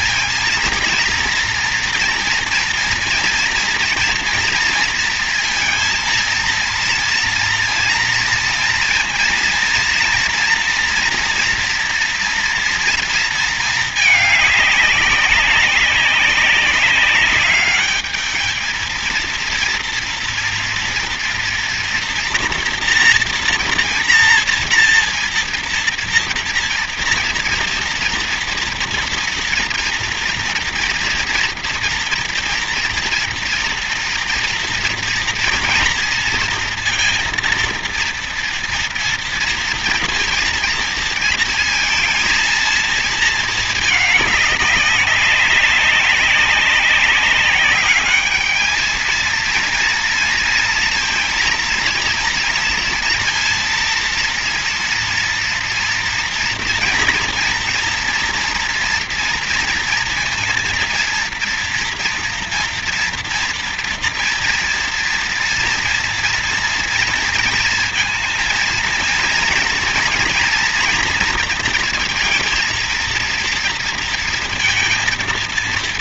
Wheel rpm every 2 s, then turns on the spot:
230, 230, 230, 230, 240, 230, 230, 210, 190, 220, 230, 240, 230, 230, 230, 230, 230, 230, 230, 230, 230, 230, 200, 200, 210, 230, 230, 230, 240, 230, 230, 240, 230, 230, 230, 230, 220, 230.
none